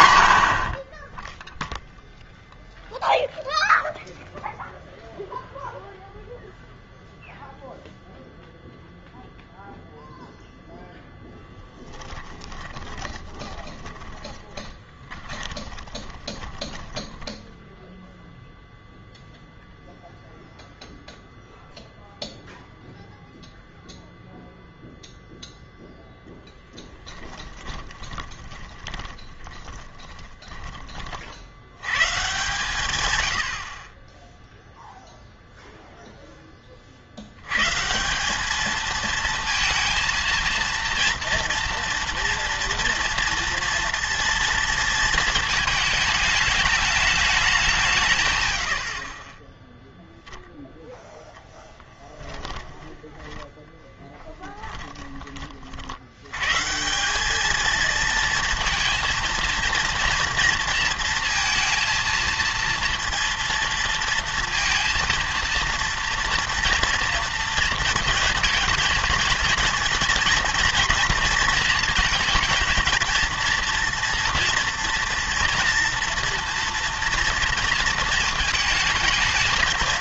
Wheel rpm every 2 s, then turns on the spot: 60, 0, 0, 0, 0, 0, 20, 20, 20, 0, 0, 0, 0, 10, 20, 20, 130, 0, 20, 210, 230, 230, 230, 210, 100, 0, 10, 20, 130, 230, 230, 230, 230, 230, 220, 230, 220, 230, 230, 220.
12-18 26-32 52-56